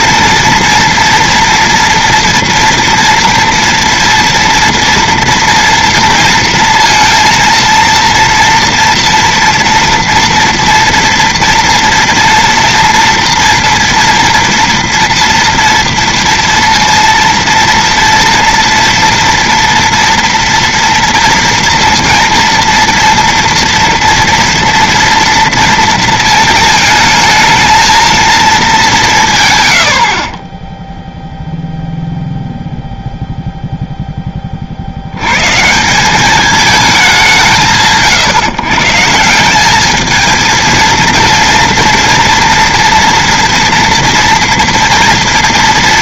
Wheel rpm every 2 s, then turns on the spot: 230, 230, 230, 230, 230, 230, 230, 230, 230, 230, 230, 230, 230, 220, 210, 20, 0, 60, 210, 150, 230, 240, 230.
none